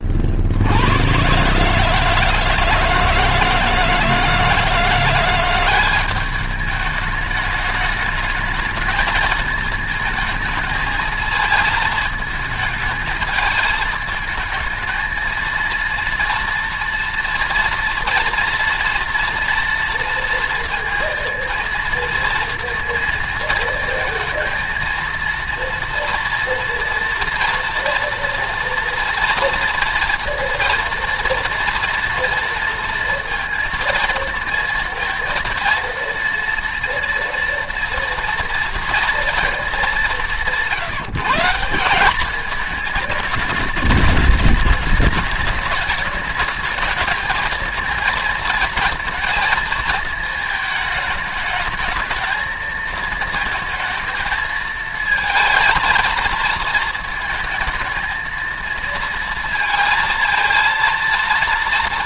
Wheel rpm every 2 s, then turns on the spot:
70, 160, 170, 210, 220, 220, 220, 220, 230, 230, 230, 230, 230, 230, 230, 230, 230, 230, 230, 230, 170, 210, 210, 210, 230, 220, 230, 220, 220, 230, 230.
none